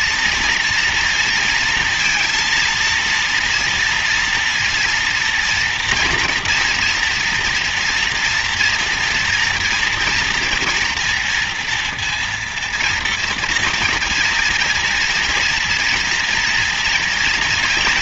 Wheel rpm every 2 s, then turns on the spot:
240, 230, 230, 230, 230, 240, 230, 230, 230.
none